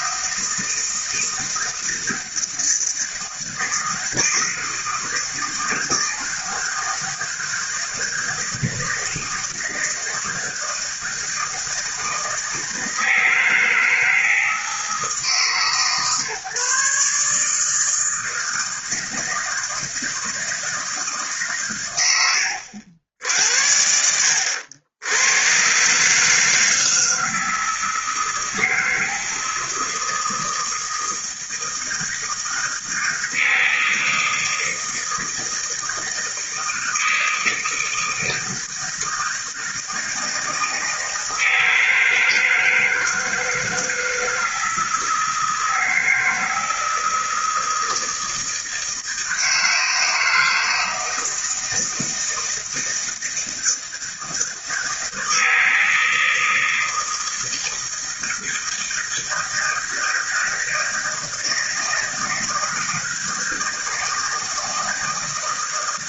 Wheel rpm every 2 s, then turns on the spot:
160, 160, 160, 160, 160, 160, 160, 160, 140, 160, 160, 80, 80, 160, 160, 160, 160, 160, 160, 160, 160, 160, 160, 160, 160, 160, 160, 160, 160, 160, 160, 160, 160.
none